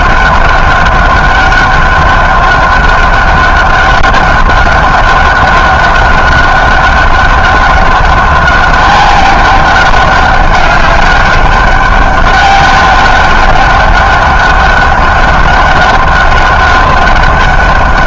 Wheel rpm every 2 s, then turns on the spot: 200, 200, 200, 200, 200, 200, 200, 200, 200.
none